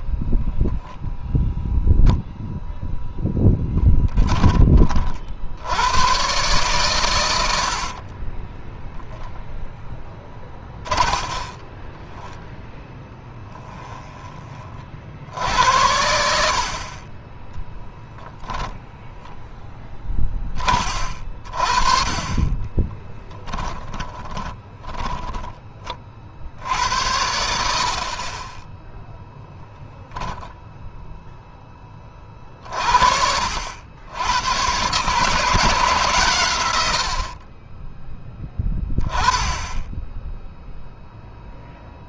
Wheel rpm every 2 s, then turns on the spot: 0, 0, 30, 120, 10, 20, 10, 30, 50, 0, 20, 20, 20, 70, 20, 0, 50, 120, 110, 10, 0.
8-14 22-26